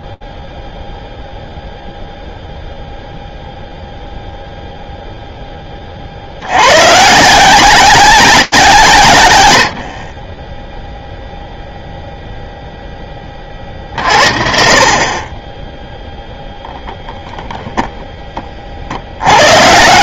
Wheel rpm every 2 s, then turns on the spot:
0, 0, 0, 130, 130, 0, 10, 40, 0, 60.
none